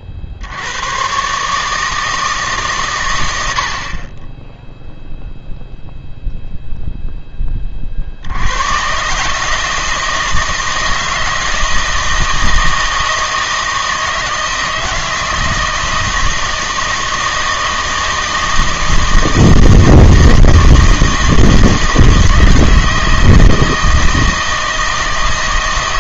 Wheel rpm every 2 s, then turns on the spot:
80, 140, 0, 0, 110, 160, 160, 160, 160, 160, 160, 160, 160.
none